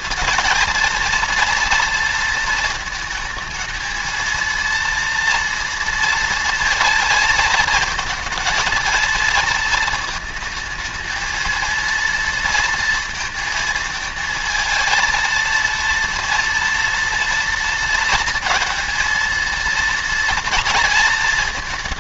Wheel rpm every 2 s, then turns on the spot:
230, 230, 230, 230, 230, 220, 230, 220, 230, 230, 230.
none